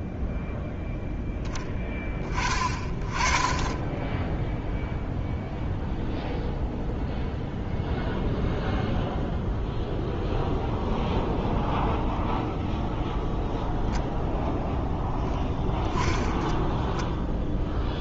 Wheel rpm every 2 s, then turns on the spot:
0, 20, 0, 0, 0, 0, 0, 0, 10.
none